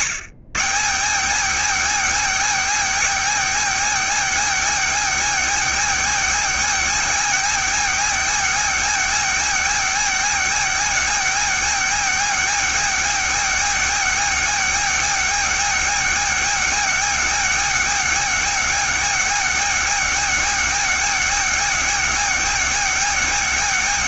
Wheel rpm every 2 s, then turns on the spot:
210, 270, 270, 270, 270, 270, 270, 270, 270, 270, 270, 270.
none